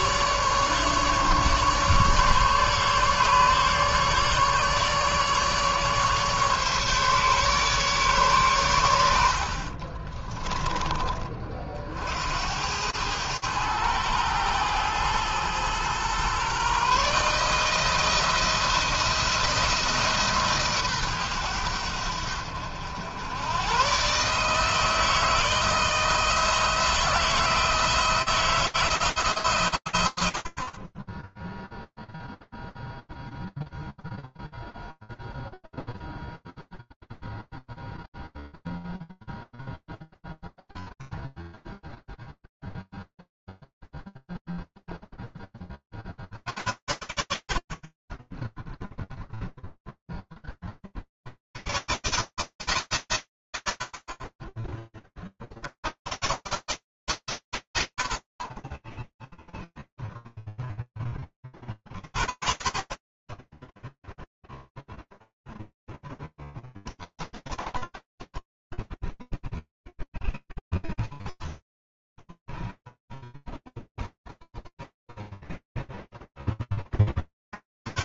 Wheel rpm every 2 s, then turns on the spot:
150, 140, 150, 140, 90, 20, 100, 110, 140, 160, 130, 90, 160, 160, 160, 40, 0, 0, 0, 0, 0, 0, 0, 50, 20, 10, 140, 50, 120, 50, 0, 30, 0, 10, 10, 0, 10, 0, 0.
68-70